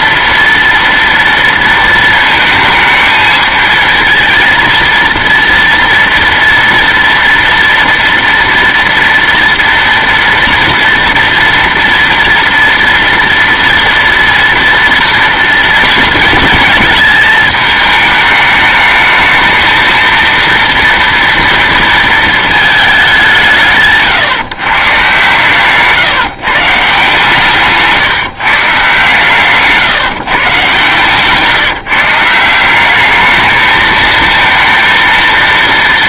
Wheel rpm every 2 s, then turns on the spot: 230, 220, 230, 230, 230, 230, 230, 240, 230, 220, 230, 220, 140, 150, 140, 140, 190, 230.
none